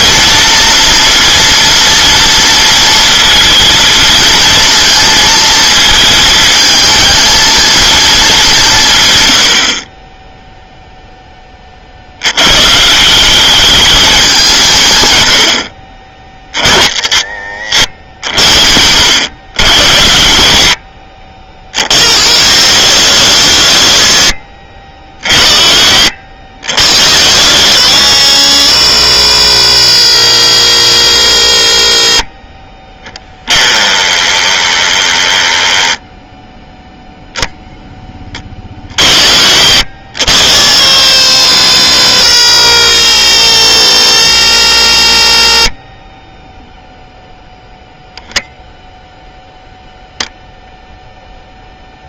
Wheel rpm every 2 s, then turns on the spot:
230, 230, 230, 220, 160, 0, 150, 130, 60, 70, 60, 70, 40, 50, 70, 60, 10, 10, 0, 30, 60, 60, 50, 0, 10, 0.
none